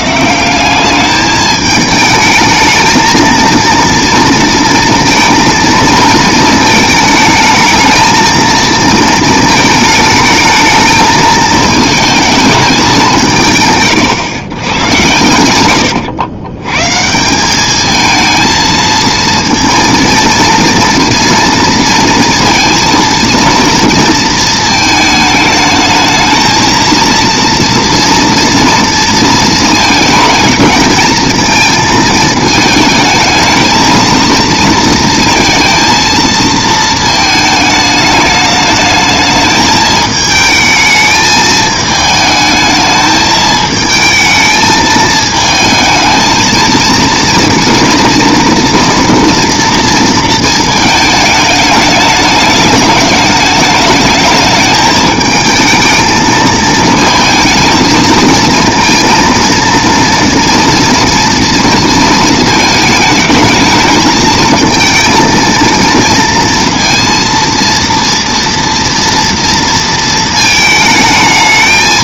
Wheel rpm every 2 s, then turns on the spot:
190, 220, 230, 220, 230, 220, 210, 120, 120, 220, 230, 230, 220, 230, 230, 220, 220, 230, 220, 210, 220, 220, 220, 220, 230, 220, 210, 210, 220, 220, 230, 220, 220, 230, 230, 220.
none